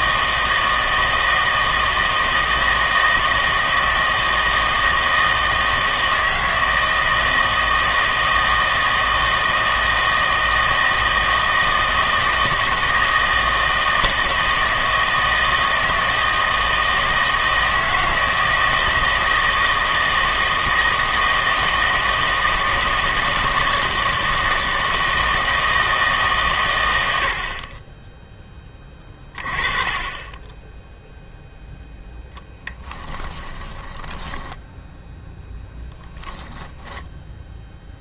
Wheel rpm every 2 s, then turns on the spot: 160, 160, 160, 160, 160, 160, 160, 160, 160, 160, 160, 160, 160, 100, 20, 0, 10, 0, 10.
32-34 36-38